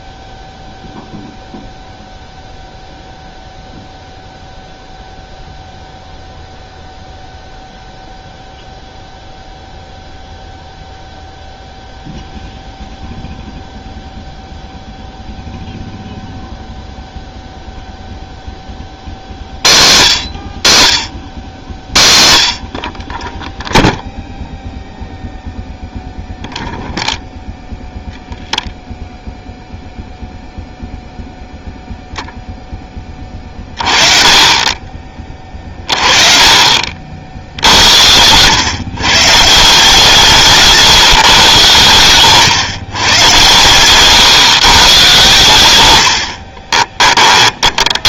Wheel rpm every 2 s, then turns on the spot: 0, 0, 0, 0, 0, 0, 0, 0, 0, 30, 80, 50, 0, 0, 0, 0, 10, 20, 30, 130, 150, 130, 130, 30.
36-38 46-48